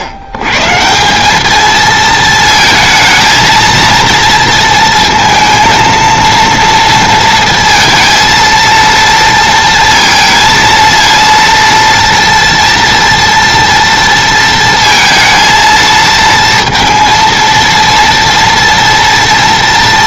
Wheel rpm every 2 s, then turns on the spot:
80, 220, 230, 230, 230, 230, 230, 230, 230, 230.
none